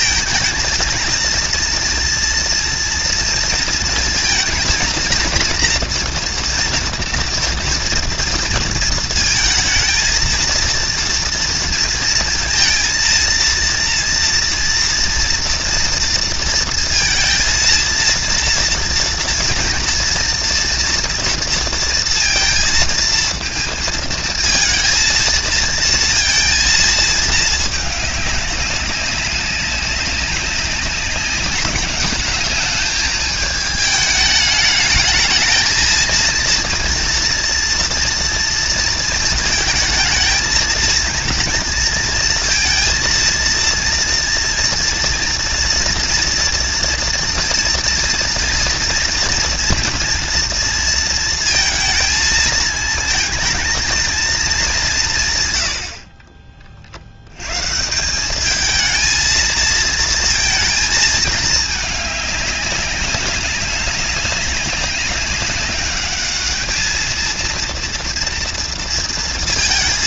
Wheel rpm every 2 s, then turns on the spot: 230, 230, 230, 240, 230, 230, 230, 230, 230, 230, 240, 230, 230, 230, 190, 190, 210, 210, 230, 230, 230, 230, 230, 230, 230, 230, 220, 200, 30, 210, 220, 200, 200, 210, 230.
none